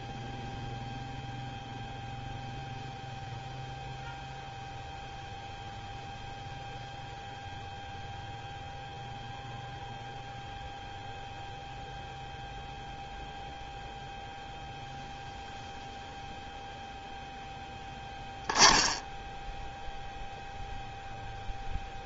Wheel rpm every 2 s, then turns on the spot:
0, 0, 0, 0, 0, 0, 0, 0, 0, 0, 0.
none